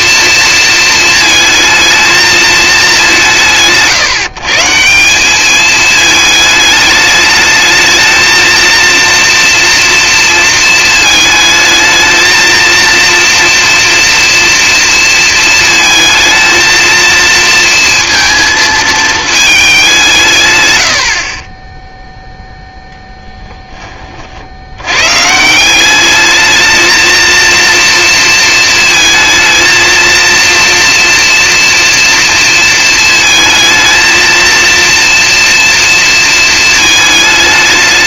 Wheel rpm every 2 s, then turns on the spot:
230, 200, 160, 210, 230, 220, 230, 230, 220, 220, 100, 0, 70, 220, 230, 230, 230, 230, 220.
none